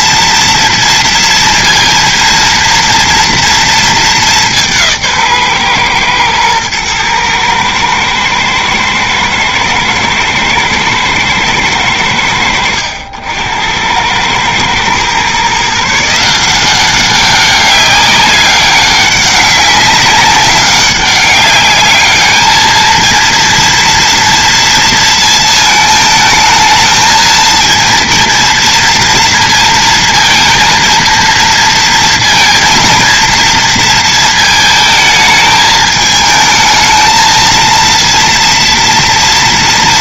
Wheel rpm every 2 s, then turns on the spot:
230, 230, 180, 110, 110, 110, 80, 110, 180, 200, 190, 220, 230, 220, 230, 230, 230, 220, 220, 230.
none